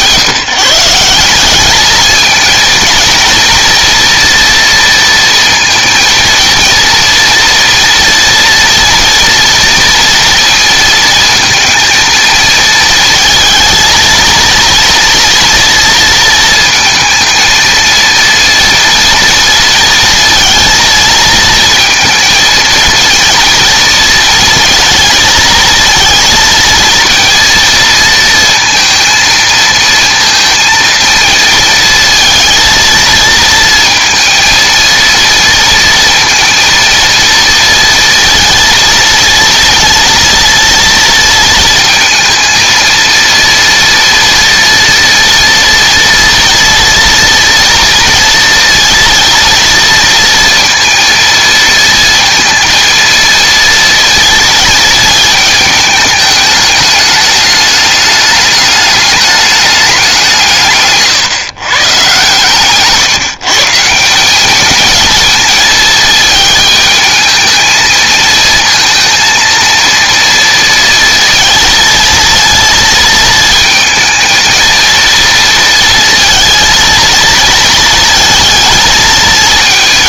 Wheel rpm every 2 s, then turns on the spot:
160, 230, 230, 230, 230, 230, 220, 230, 230, 230, 230, 230, 230, 230, 230, 230, 230, 230, 230, 230, 230, 230, 230, 230, 230, 230, 230, 230, 210, 210, 140, 140, 210, 220, 230, 230, 230, 230, 230, 220.
none